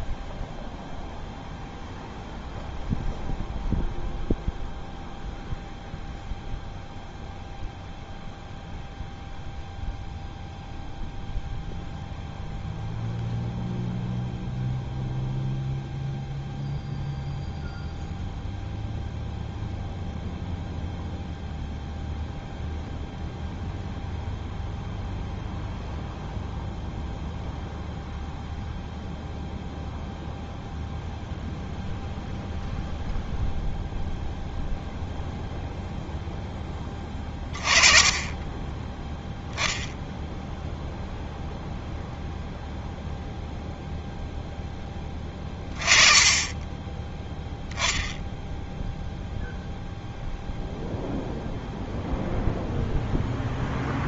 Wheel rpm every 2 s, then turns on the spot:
0, 0, 0, 0, 0, 0, 0, 0, 0, 0, 0, 0, 0, 0, 0, 0, 0, 0, 10, 10, 0, 0, 10, 20, 0, 0, 0.
none